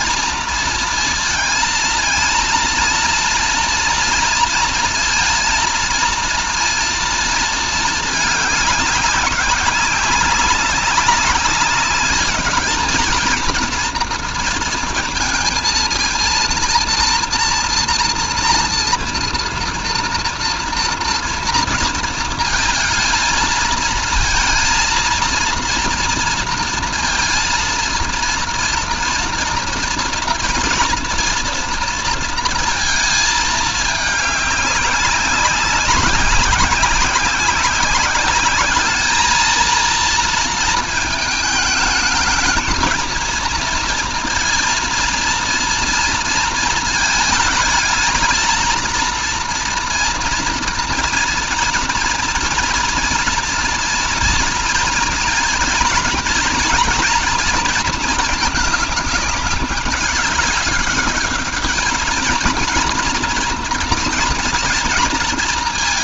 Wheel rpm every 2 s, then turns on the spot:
230, 230, 230, 230, 200, 200, 220, 230, 230, 230, 230, 220, 230, 230, 230, 240, 220, 200, 190, 220, 220, 220, 230, 220, 230, 230, 230, 230, 230, 210, 210, 230, 230.
none